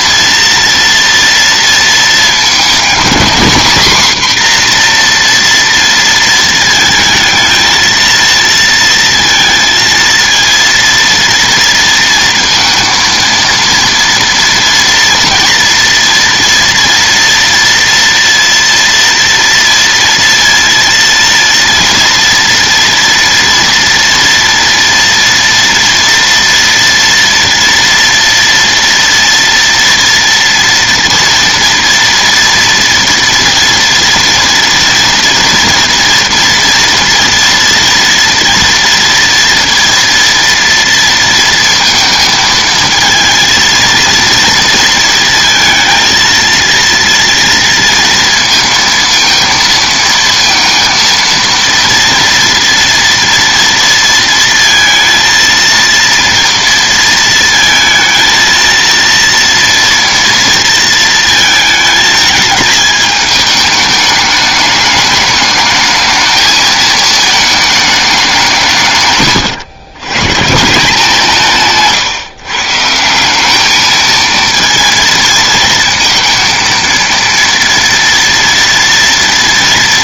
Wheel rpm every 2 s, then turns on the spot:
230, 220, 250, 230, 230, 230, 230, 230, 230, 230, 230, 230, 230, 230, 230, 230, 240, 230, 240, 230, 230, 220, 230, 230, 230, 230, 230, 230, 230, 230, 230, 220, 210, 220, 160, 170, 150, 230, 230, 240.
none